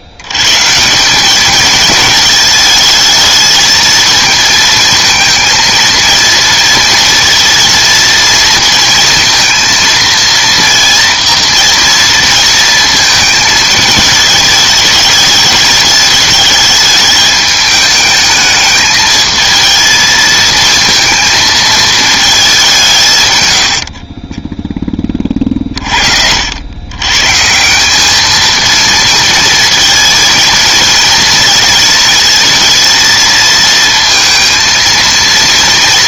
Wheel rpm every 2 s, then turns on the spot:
100, 220, 230, 220, 230, 230, 230, 210, 210, 210, 220, 200, 20, 80, 220, 230, 230, 230.
none